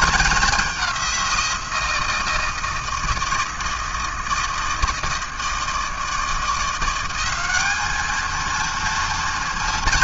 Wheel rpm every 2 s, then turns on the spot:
210, 170, 160, 160, 210.
none